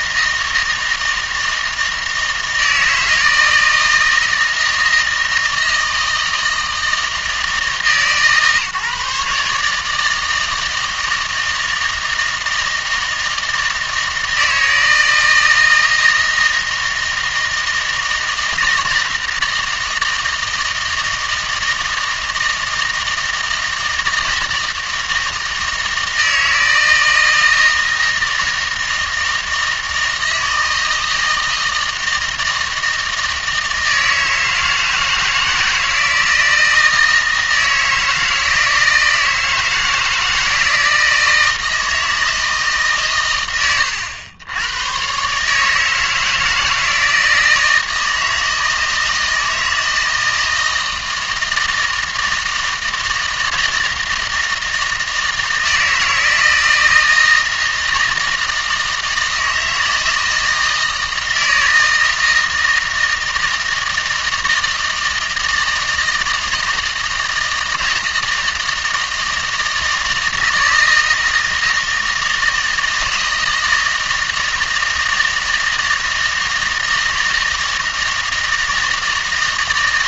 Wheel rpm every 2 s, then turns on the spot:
160, 160, 160, 160, 150, 160, 160, 160, 160, 160, 160, 160, 160, 160, 160, 160, 160, 160, 160, 160, 160, 150, 110, 160, 160, 160, 160, 160, 160, 160, 160, 160, 160, 160, 160, 160, 160, 160, 160, 160.
none